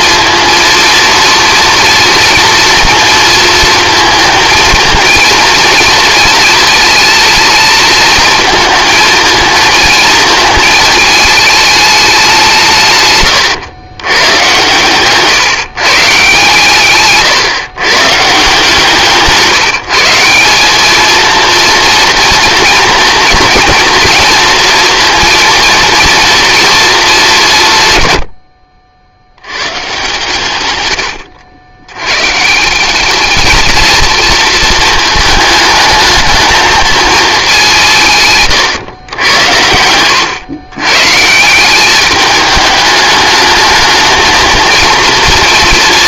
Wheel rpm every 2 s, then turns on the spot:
230, 230, 220, 220, 220, 230, 160, 120, 140, 170, 200, 230, 230, 230, 70, 110, 190, 220, 220, 130, 120, 210, 230.
none